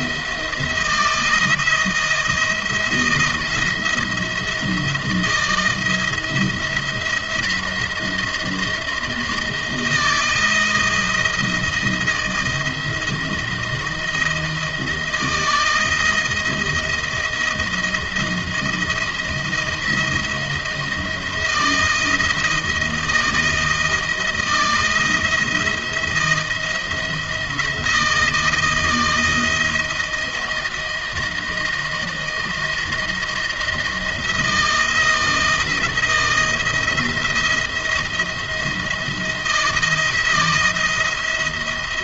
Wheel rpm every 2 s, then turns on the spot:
170, 170, 170, 170, 170, 160, 160, 160, 160, 160, 170, 170, 160, 160, 160, 170, 170, 170, 170, 170, 160.
none